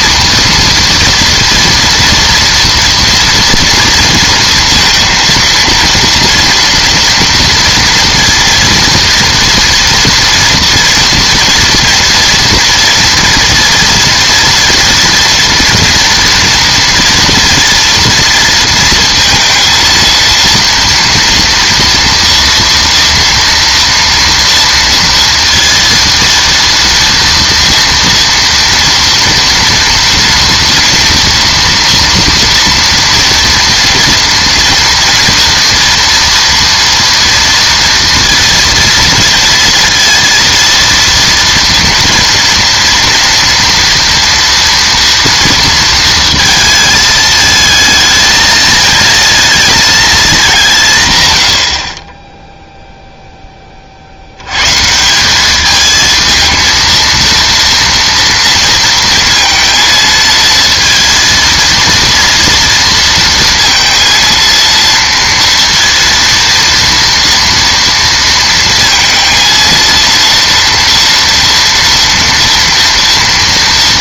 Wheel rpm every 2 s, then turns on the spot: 230, 240, 230, 230, 230, 230, 230, 240, 230, 230, 230, 230, 230, 230, 230, 230, 230, 240, 230, 230, 230, 230, 230, 220, 220, 160, 0, 130, 230, 230, 230, 230, 230, 230, 230, 230, 230.
none